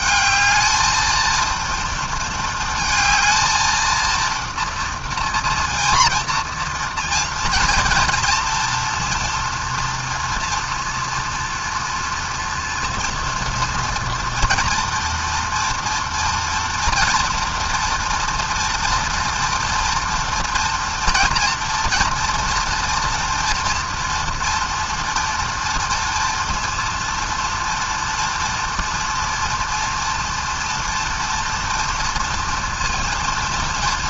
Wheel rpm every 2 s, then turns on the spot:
220, 220, 230, 230, 230, 230, 230, 230, 230, 230, 230, 240, 230, 230, 230, 230, 230.
none